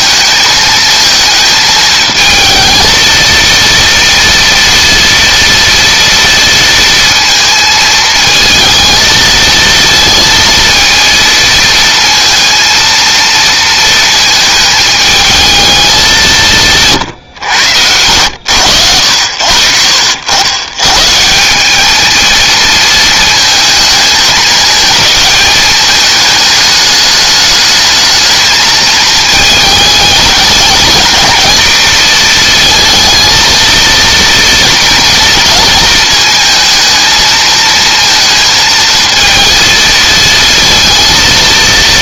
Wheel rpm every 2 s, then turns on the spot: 220, 220, 230, 230, 220, 230, 230, 220, 150, 80, 120, 230, 220, 210, 220, 220, 230, 230, 220, 220, 230.
16-18